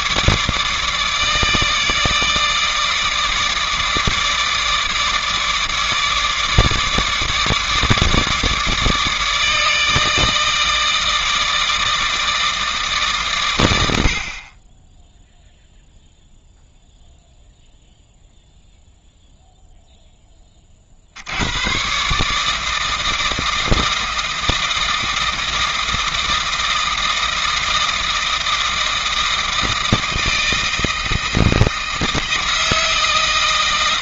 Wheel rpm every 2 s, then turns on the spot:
150, 150, 150, 150, 150, 160, 150, 20, 0, 0, 40, 160, 160, 160, 160, 160, 160.
none